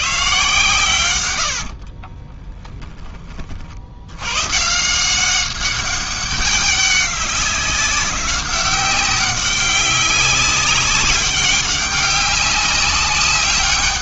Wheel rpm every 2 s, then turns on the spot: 120, 20, 140, 200, 190, 190, 200.
2-4